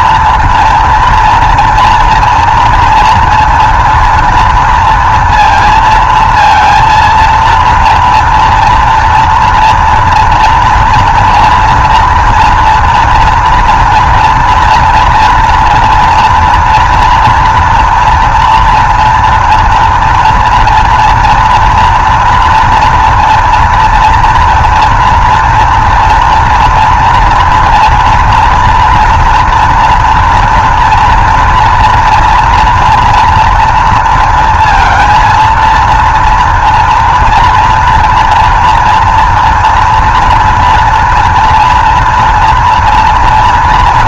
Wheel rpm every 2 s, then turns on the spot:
230, 230, 230, 230, 230, 230, 230, 230, 230, 230, 230, 240, 230, 230, 240, 240, 230, 230, 230, 230, 230, 230.
none